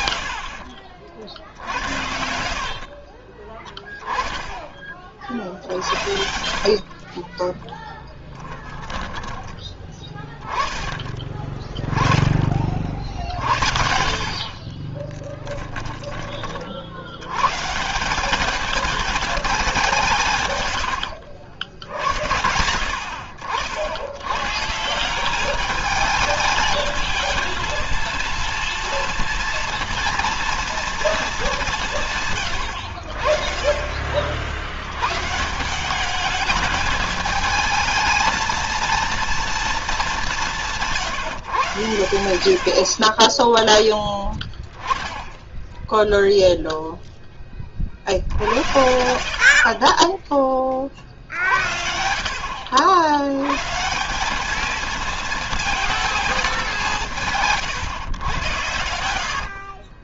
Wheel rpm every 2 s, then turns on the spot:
60, 50, 20, 40, 10, 20, 50, 30, 60, 210, 110, 80, 160, 220, 230, 230, 80, 90, 210, 230, 170, 60, 10, 0, 80, 30, 80, 220, 180, 80.
2-4 6-10 14-16 48-50 58-60